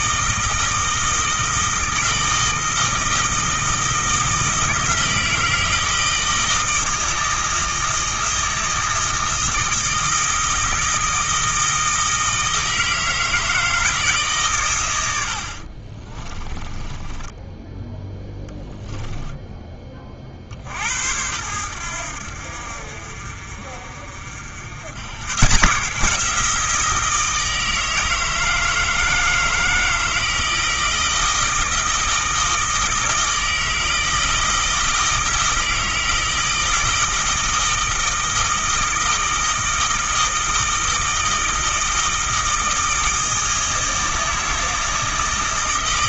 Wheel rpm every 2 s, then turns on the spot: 160, 160, 160, 160, 160, 160, 160, 110, 30, 10, 70, 60, 90, 170, 160, 160, 160, 160, 160, 160, 160, 160, 160.
16-20